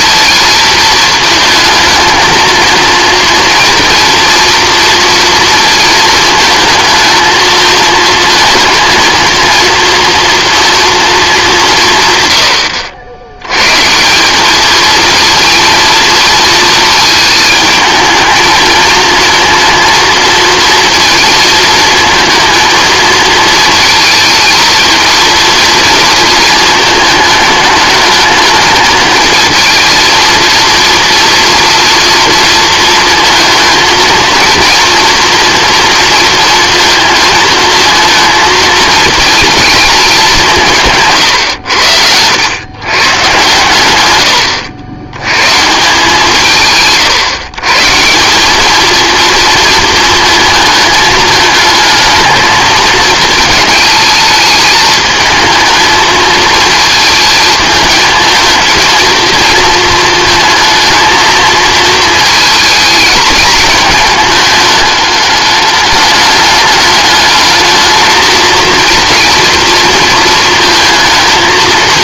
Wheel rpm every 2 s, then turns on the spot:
220, 230, 230, 230, 230, 230, 90, 220, 220, 220, 230, 220, 230, 220, 210, 230, 230, 230, 230, 220, 160, 120, 80, 150, 210, 220, 220, 220, 230, 220, 230, 220, 210, 210, 230, 230.
none